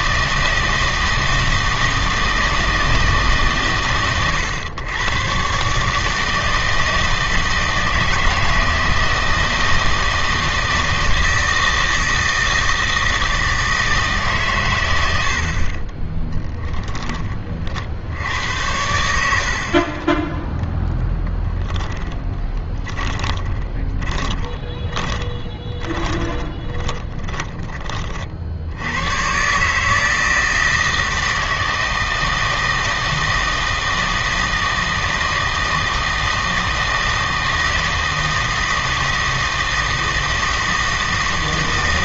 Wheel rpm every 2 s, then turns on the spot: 160, 160, 110, 160, 160, 160, 160, 110, 10, 90, 0, 10, 20, 20, 70, 160, 160, 160, 160, 160, 160.
16-18 22-28